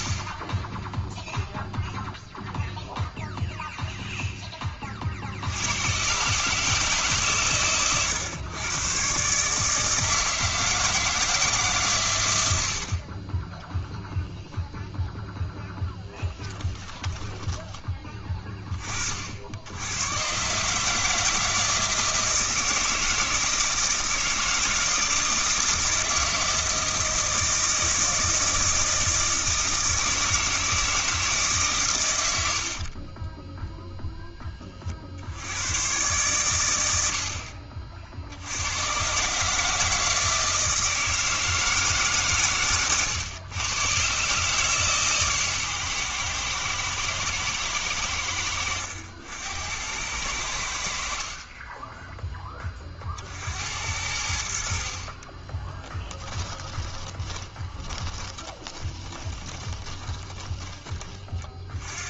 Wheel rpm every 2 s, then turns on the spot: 20, 0, 20, 150, 110, 160, 70, 0, 10, 30, 140, 160, 160, 160, 160, 160, 70, 20, 100, 90, 160, 130, 150, 120, 80, 70, 20, 60, 20, 10, 30.
16-18 32-34 42-44 56-60